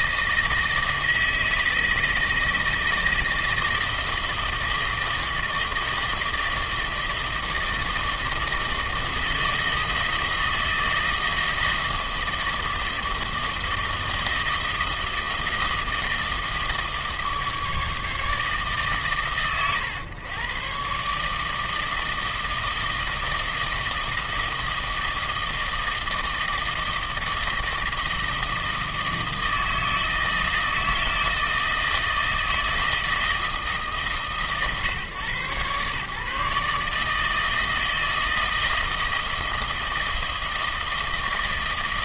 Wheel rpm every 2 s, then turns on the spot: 160, 160, 160, 160, 160, 160, 160, 160, 160, 130, 130, 160, 160, 160, 160, 160, 160, 130, 150, 160, 160.
none